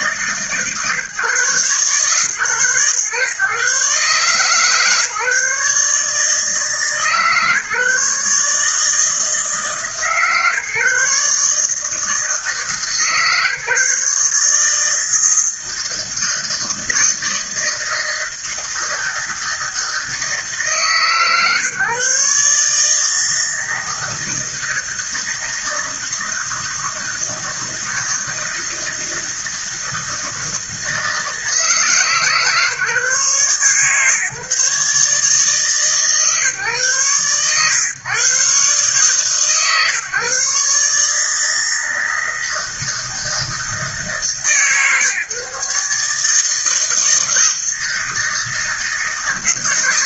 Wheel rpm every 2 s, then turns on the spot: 150, 130, 150, 150, 150, 140, 160, 160, 160, 160, 140, 150, 160, 160, 160, 160, 150, 150, 120, 140, 140, 160, 150, 160, 160.
none